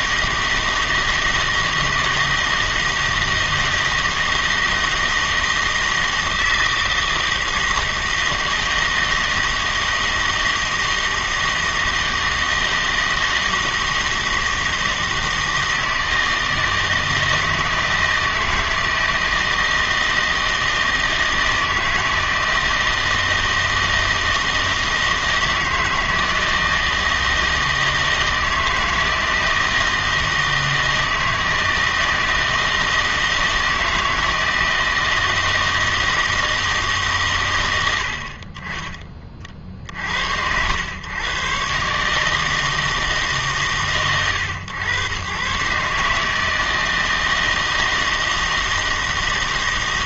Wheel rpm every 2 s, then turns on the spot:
160, 160, 160, 160, 160, 160, 160, 160, 160, 160, 160, 160, 160, 160, 160, 160, 160, 160, 150, 30, 100, 160, 110, 160, 160.
none